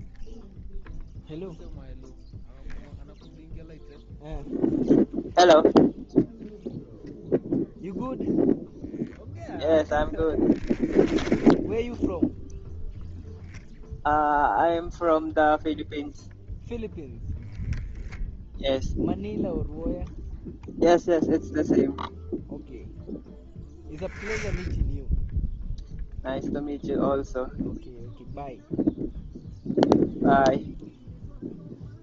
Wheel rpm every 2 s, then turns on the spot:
0, 0, 0, 0, 0, 10, 0, 0, 0, 0, 0, 0, 10, 0, 0, 0.
10-12